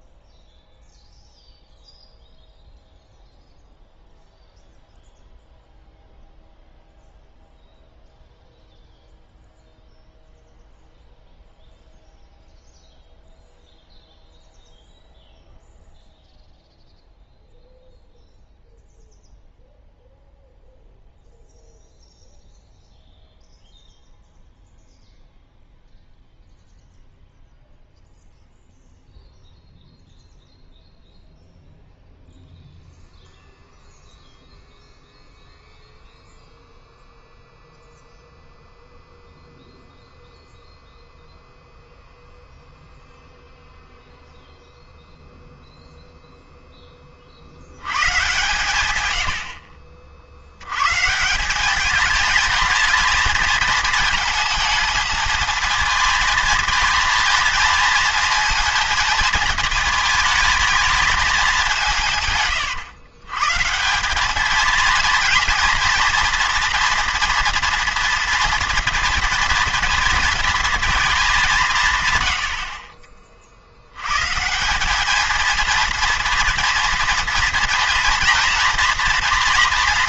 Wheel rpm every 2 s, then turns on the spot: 0, 0, 0, 0, 0, 0, 0, 0, 0, 0, 0, 0, 0, 0, 0, 0, 0, 0, 0, 0, 0, 0, 0, 0, 120, 100, 220, 220, 230, 230, 220, 110, 220, 240, 230, 220, 60, 180, 230, 230.
none